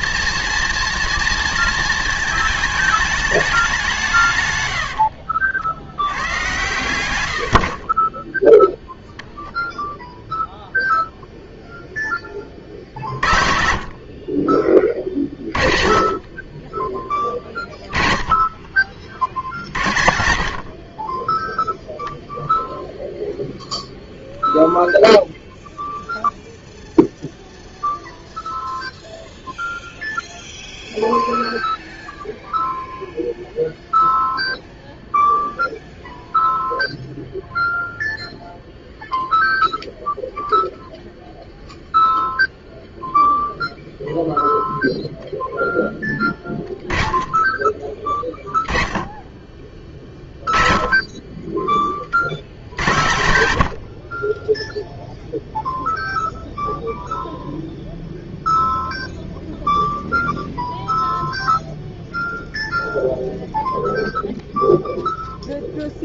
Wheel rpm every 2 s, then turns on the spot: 230, 220, 120, 110, 10, 0, 30, 30, 20, 30, 60, 0, 0, 0, 0, 0, 0, 0, 0, 0, 0, 0, 0, 10, 20, 20, 70, 10, 0, 0, 0, 0, 0.
6-8 14-16 54-56